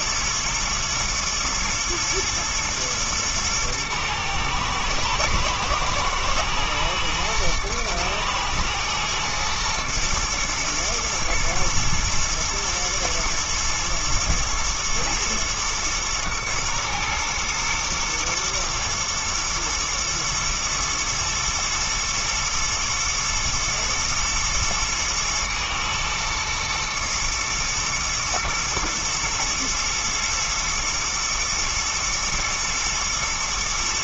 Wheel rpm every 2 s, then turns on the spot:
110, 110, 120, 110, 120, 120, 120, 110, 110, 120, 110, 120, 120, 110, 120, 110, 110.
none